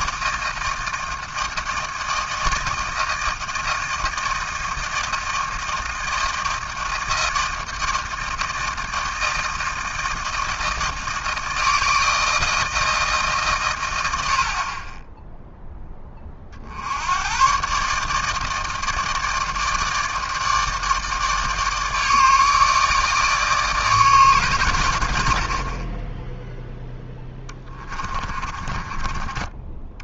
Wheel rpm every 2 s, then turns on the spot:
160, 160, 160, 160, 160, 160, 150, 10, 110, 160, 150, 150, 70, 20, 30.
26-30